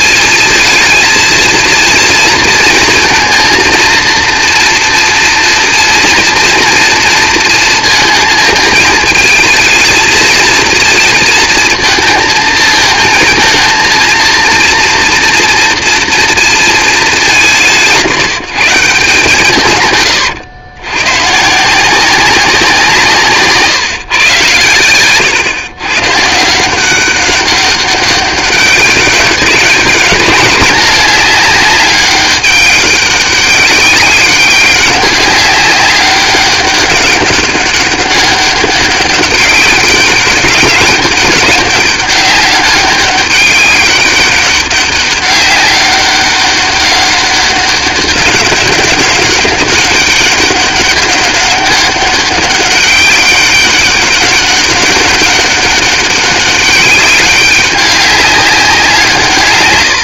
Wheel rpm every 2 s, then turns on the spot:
220, 230, 230, 230, 220, 230, 220, 230, 230, 160, 110, 180, 120, 160, 190, 200, 200, 200, 200, 190, 200, 200, 200, 190, 190, 200, 190, 200, 200, 190.
none